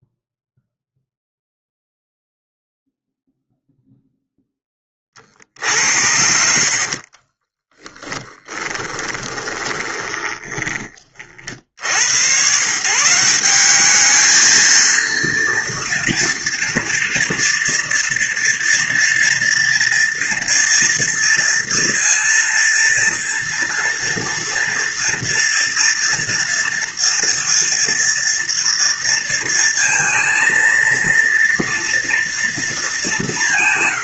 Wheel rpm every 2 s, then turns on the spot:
0, 0, 30, 50, 20, 20, 150, 230, 230, 230, 230, 230, 230, 230, 230, 230, 200.
6-10